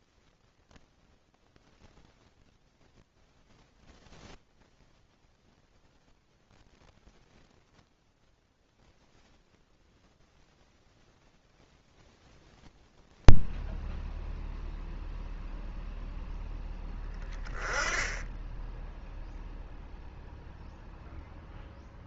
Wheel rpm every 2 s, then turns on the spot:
0, 10, 0, 0, 0, 0, 0, 0, 0, 10, 0.
none